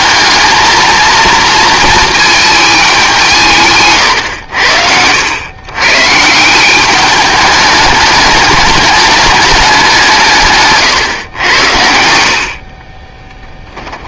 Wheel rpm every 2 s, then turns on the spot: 220, 220, 90, 180, 200, 140, 50.
none